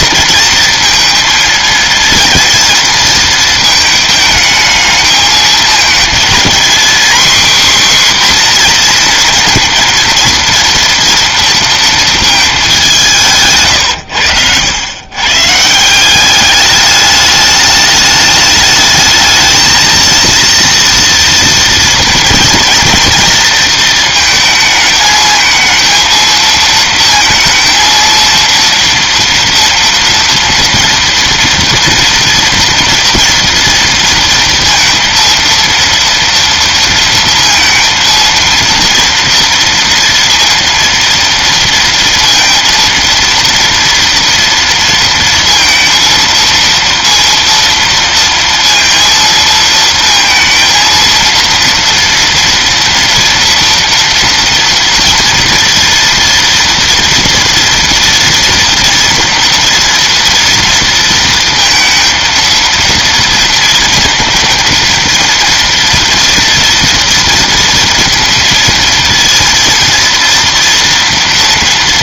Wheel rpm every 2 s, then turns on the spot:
230, 230, 220, 240, 250, 230, 210, 100, 200, 210, 230, 230, 220, 230, 230, 230, 230, 230, 230, 230, 230, 230, 230, 230, 230, 230, 230, 230, 230, 230, 230, 230, 230, 230, 230, 230.
none